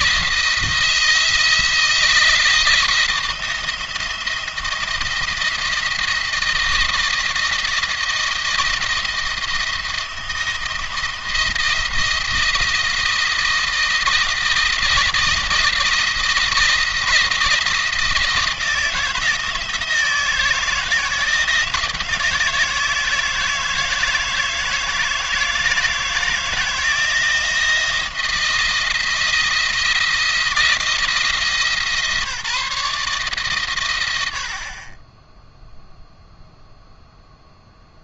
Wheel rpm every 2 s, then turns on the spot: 170, 160, 170, 170, 170, 170, 170, 170, 170, 160, 160, 160, 160, 160, 170, 160, 160, 10, 0.
none